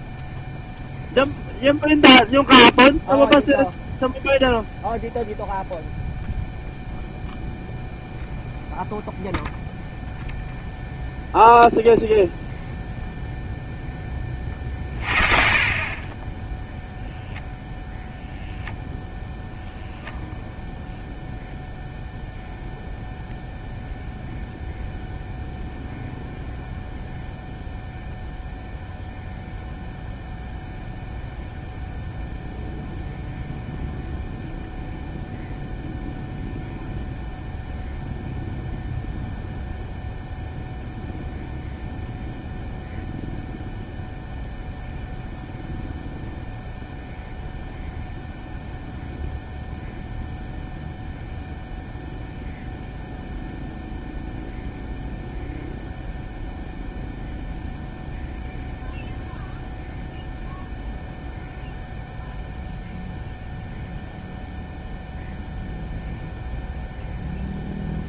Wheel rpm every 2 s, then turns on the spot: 0, 0, 0, 0, 0, 0, 0, 20, 10, 0, 0, 0, 0, 0, 0, 0, 0, 0, 0, 0, 0, 0, 0, 0, 0, 0, 0, 0, 0, 0, 0, 0, 0, 0.
none